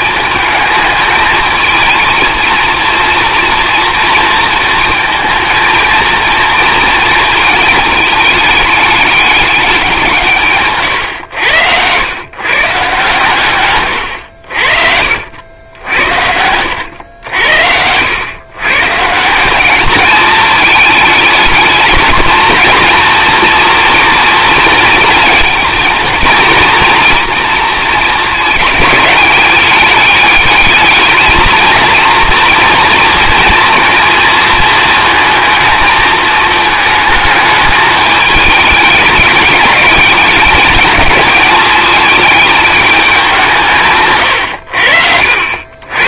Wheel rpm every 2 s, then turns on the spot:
220, 230, 230, 230, 210, 130, 160, 60, 90, 140, 220, 240, 230, 230, 210, 210, 230, 220, 220, 210, 210, 210, 70.
14-16 44-46